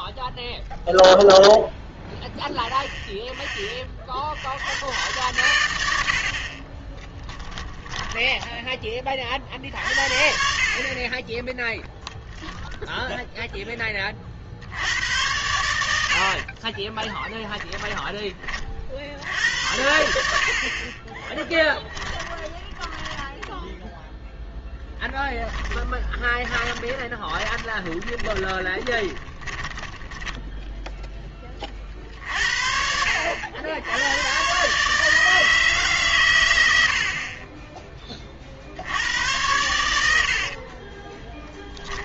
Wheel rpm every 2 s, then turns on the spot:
0, 0, 90, 20, 30, 40, 0, 80, 20, 50, 40, 10, 0, 20, 30, 0, 60, 150, 70, 80, 30.
6-8 16-18 22-24 26-30 40-42